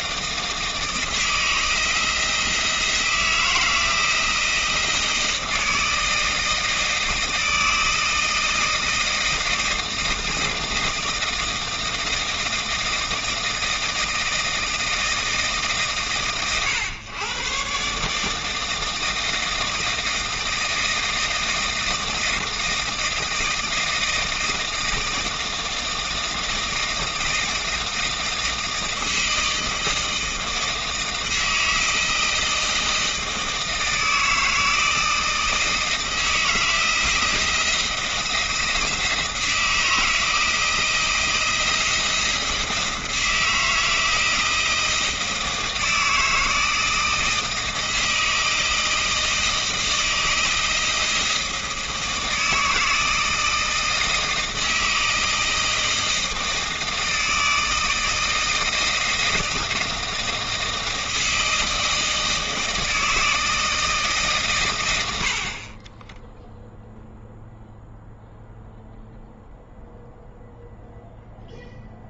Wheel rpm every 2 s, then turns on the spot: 160, 160, 160, 160, 160, 160, 160, 160, 110, 160, 160, 160, 160, 160, 160, 160, 160, 160, 170, 170, 170, 160, 160, 160, 160, 160, 160, 160, 160, 160, 160, 160, 90, 0, 0, 0.
none